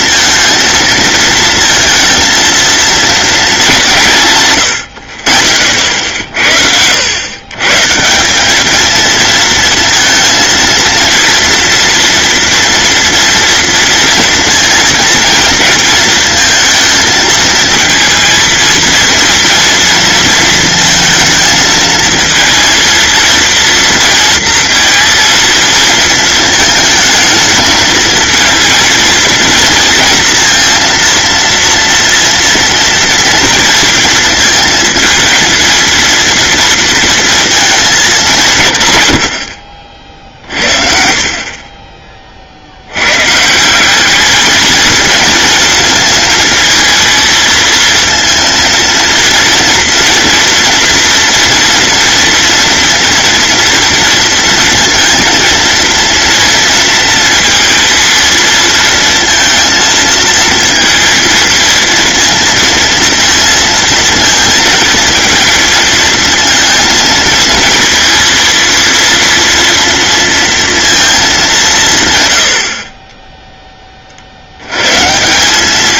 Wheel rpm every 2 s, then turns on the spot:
230, 230, 90, 90, 220, 230, 240, 230, 230, 230, 230, 230, 230, 220, 230, 230, 230, 220, 230, 140, 50, 90, 220, 220, 230, 230, 230, 230, 230, 230, 230, 230, 230, 230, 230, 230, 60, 110.
4-6